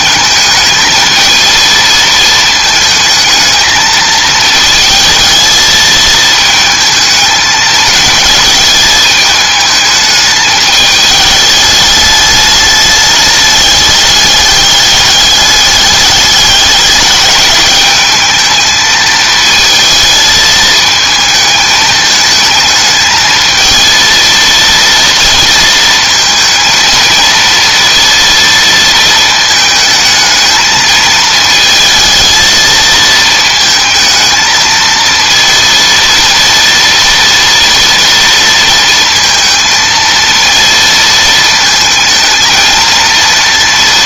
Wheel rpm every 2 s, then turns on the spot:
220, 220, 220, 220, 210, 210, 210, 210, 200, 220, 220, 220, 230, 230, 230, 220, 230, 220, 230, 230, 230, 220.
none